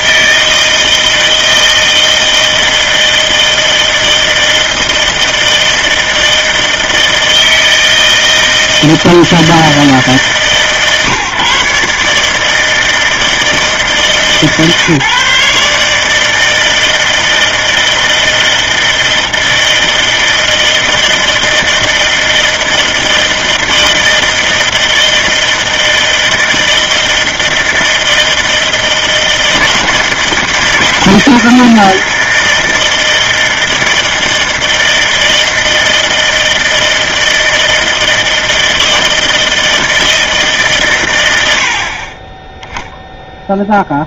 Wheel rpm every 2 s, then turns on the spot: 160, 160, 160, 160, 160, 140, 160, 150, 160, 160, 160, 160, 160, 160, 160, 160, 160, 160, 160, 160, 140, 0.
none